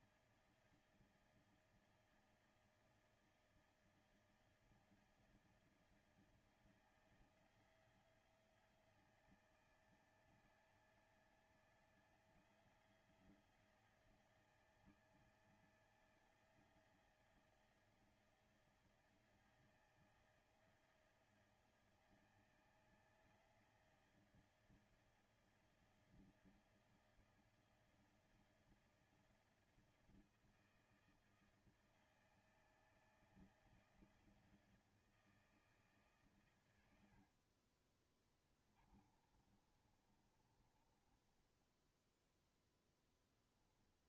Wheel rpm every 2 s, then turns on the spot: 160, 160, 160, 160, 160, 160, 170, 160, 160, 160, 160, 160, 160, 160, 160, 160, 160, 160, 110, 30, 20, 10.
36-42